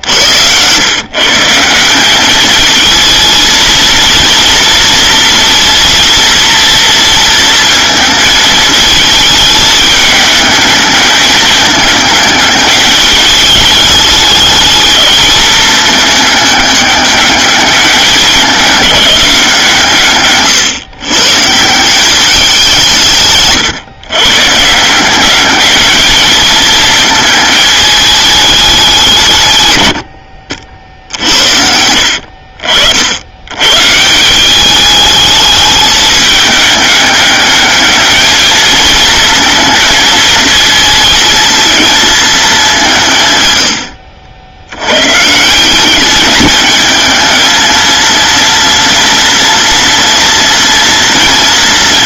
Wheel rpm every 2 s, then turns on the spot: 140, 220, 230, 230, 220, 210, 210, 210, 210, 190, 140, 160, 190, 220, 140, 60, 80, 210, 210, 230, 220, 140, 140, 220, 230, 230.
none